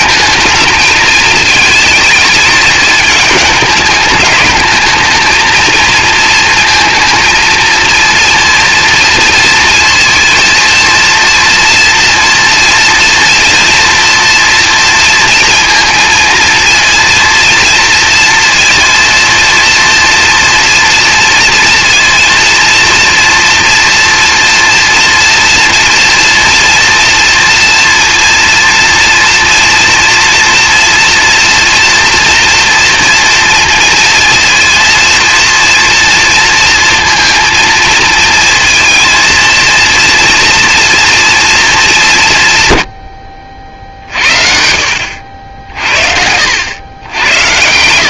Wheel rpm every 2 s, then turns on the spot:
220, 220, 210, 230, 230, 230, 230, 230, 230, 230, 230, 230, 230, 240, 230, 240, 240, 230, 230, 230, 230, 130, 60, 100.
none